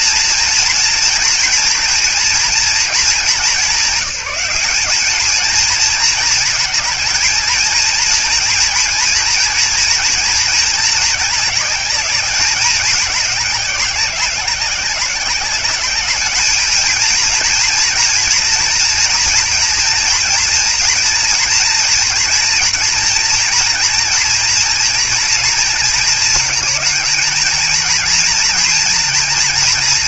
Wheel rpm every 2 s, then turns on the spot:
230, 220, 200, 220, 230, 220, 200, 190, 220, 230, 240, 240, 230, 220, 230.
none